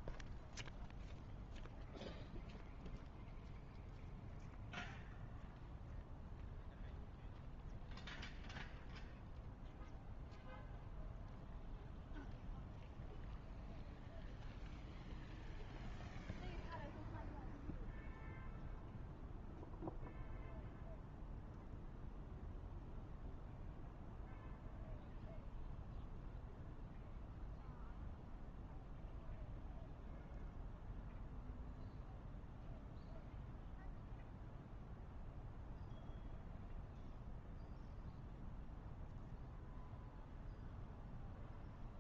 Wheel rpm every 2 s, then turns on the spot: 0, 0, 0, 0, 0, 0, 0, 0, 0, 0, 0, 0, 0, 0, 0, 0, 0, 0, 0, 0, 0.
none